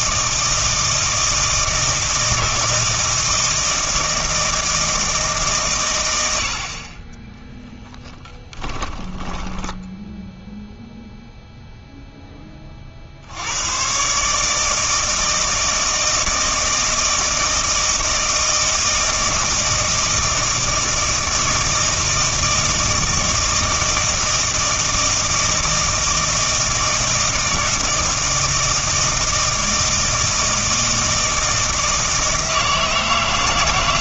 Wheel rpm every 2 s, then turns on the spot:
160, 160, 160, 30, 10, 0, 40, 160, 160, 160, 160, 160, 160, 160, 160, 160, 160.
8-10